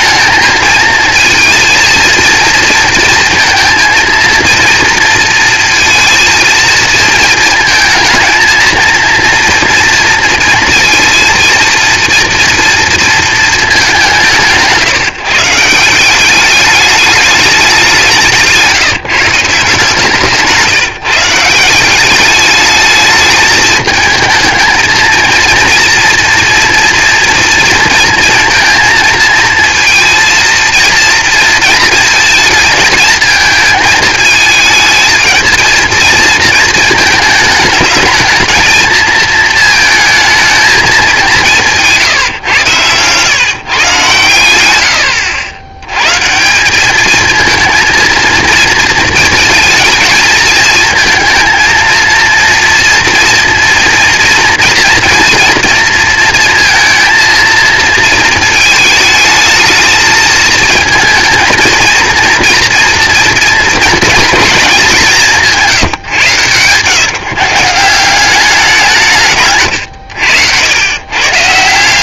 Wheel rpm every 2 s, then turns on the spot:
220, 230, 230, 230, 220, 230, 230, 150, 200, 160, 170, 210, 220, 230, 230, 230, 220, 220, 220, 220, 220, 120, 110, 190, 220, 220, 230, 240, 230, 220, 220, 240, 210, 120, 190, 110.
none